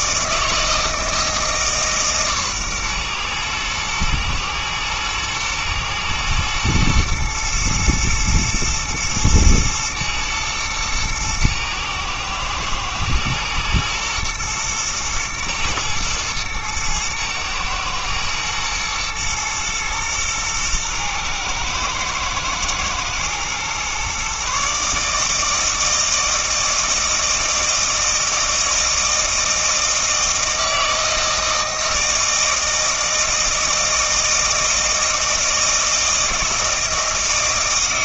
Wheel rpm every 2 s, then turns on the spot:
160, 130, 120, 120, 110, 110, 110, 120, 110, 120, 110, 110, 140, 160, 160, 160, 160, 160, 160.
none